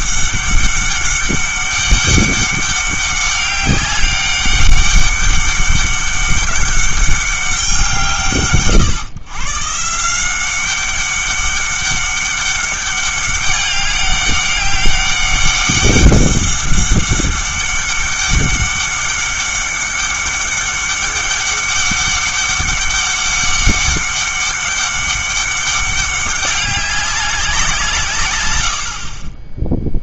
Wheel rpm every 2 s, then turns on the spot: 200, 200, 200, 200, 140, 190, 200, 200, 200, 200, 200, 200, 200, 200, 70.
none